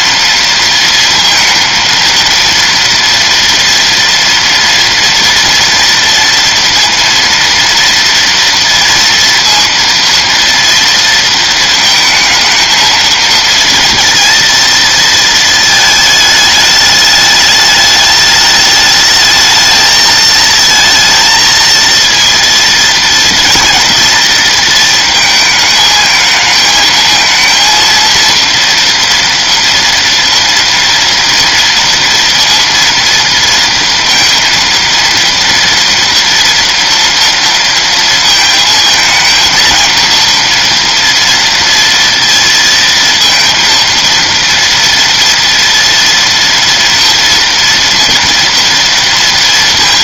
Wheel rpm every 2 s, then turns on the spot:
230, 230, 230, 230, 230, 230, 220, 230, 210, 210, 220, 230, 230, 220, 230, 230, 230, 230, 230, 220, 230, 230, 230, 230, 240.
none